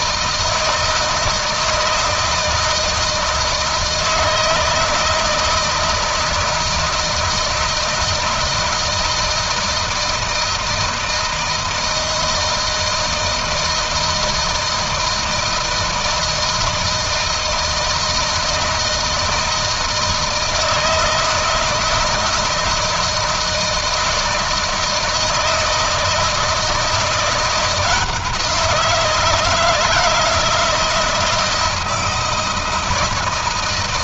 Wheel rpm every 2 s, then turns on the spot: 160, 160, 160, 160, 160, 160, 160, 160, 160, 160, 160, 160, 160, 170, 170, 160, 160.
none